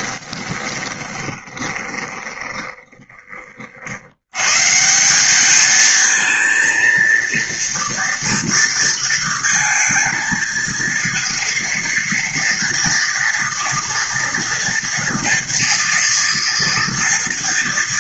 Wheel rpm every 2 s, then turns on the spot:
20, 20, 110, 220, 230, 230, 240, 230, 240.
0-4